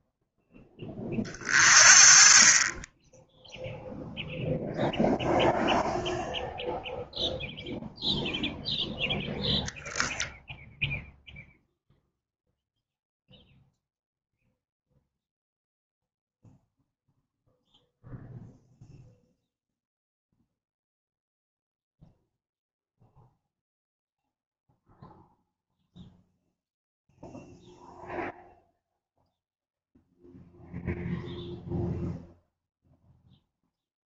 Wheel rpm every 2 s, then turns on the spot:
20, 10, 0, 0, 0, 0, 0, 0, 0, 0, 0, 0, 0, 0, 0, 0, 0.
none